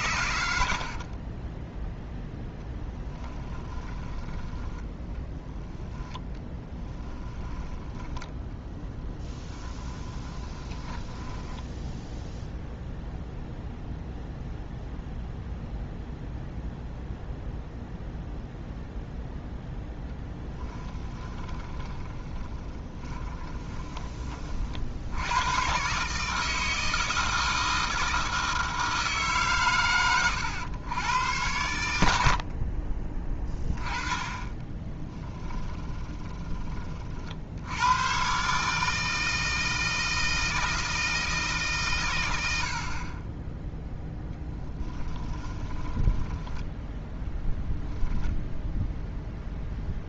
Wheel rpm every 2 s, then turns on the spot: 60, 10, 20, 10, 10, 20, 0, 0, 0, 0, 10, 20, 60, 160, 160, 100, 30, 20, 30, 150, 160, 60, 10, 20, 0.
0-4 6-12 20-24 32-36 44-48